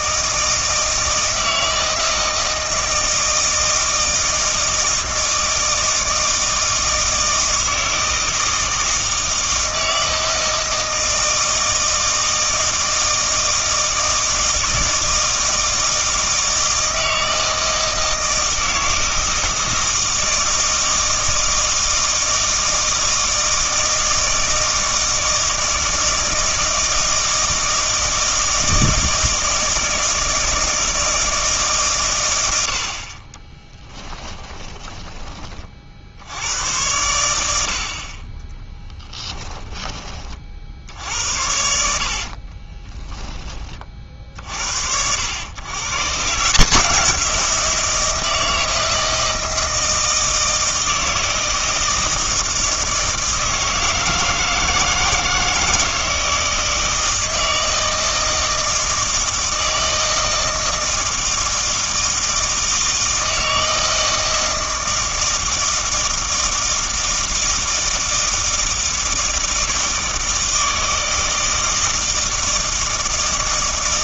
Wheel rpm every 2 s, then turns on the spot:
160, 160, 160, 160, 160, 160, 160, 160, 160, 160, 160, 160, 160, 160, 160, 160, 70, 20, 100, 10, 60, 20, 70, 170, 160, 160, 160, 160, 160, 160, 160, 160, 160, 160, 160, 160, 160.
34-36 38-40 42-44